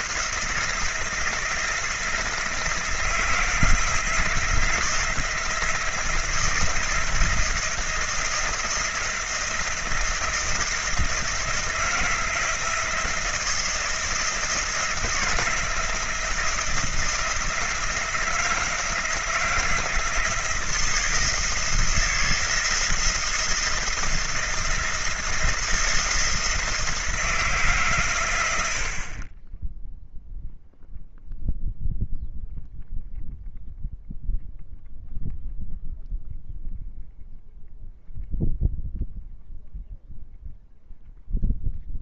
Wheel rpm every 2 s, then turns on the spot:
170, 160, 170, 170, 170, 170, 170, 170, 160, 160, 170, 170, 170, 160, 80, 0, 0, 0, 0, 0, 0.
none